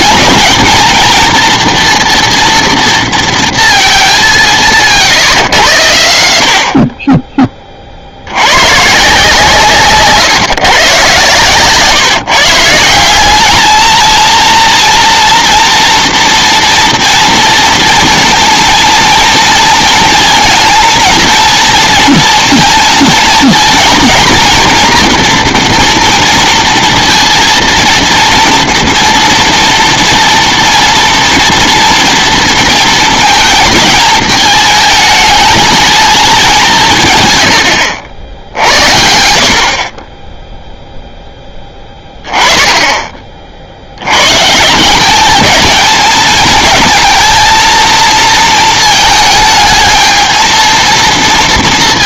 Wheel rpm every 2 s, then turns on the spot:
220, 230, 170, 60, 110, 140, 160, 230, 230, 230, 230, 230, 230, 230, 230, 230, 220, 220, 200, 80, 0, 20, 150, 220, 230, 220.
none